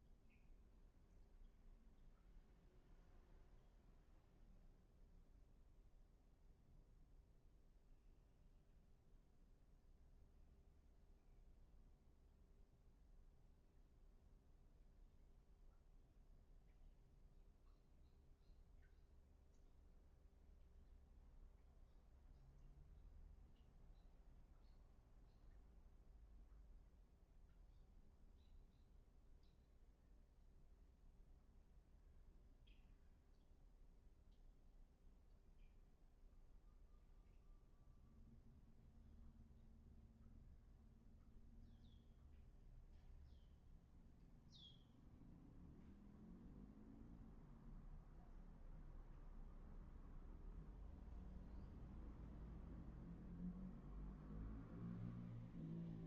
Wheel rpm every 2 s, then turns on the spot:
0, 0, 0, 0, 0, 0, 0, 0, 0, 0, 0, 0, 0, 0, 0, 0, 0, 0, 0, 0, 0, 0, 0, 0, 0, 0, 0, 0.
none